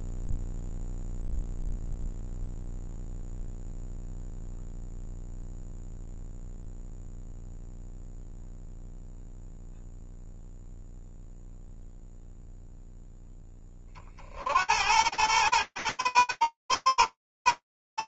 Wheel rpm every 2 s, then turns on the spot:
0, 0, 0, 0, 0, 0, 30, 110, 120.
none